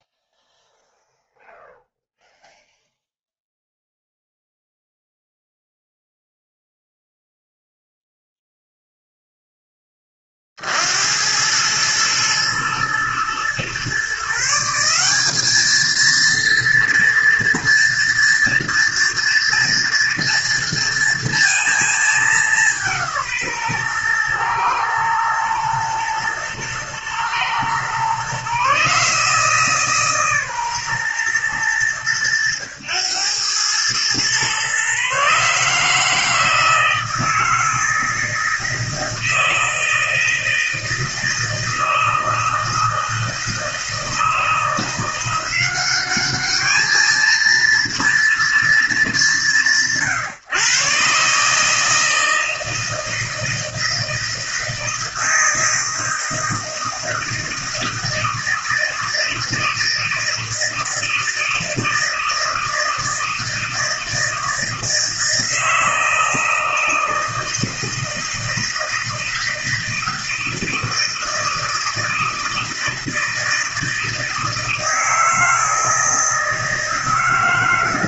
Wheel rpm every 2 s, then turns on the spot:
0, 0, 0, 0, 0, 50, 110, 160, 230, 230, 230, 190, 120, 120, 130, 140, 110, 120, 160, 160, 160, 160, 160, 210, 220, 130, 160, 160, 160, 160, 160, 160, 160, 160, 160, 160, 160, 160, 160.
none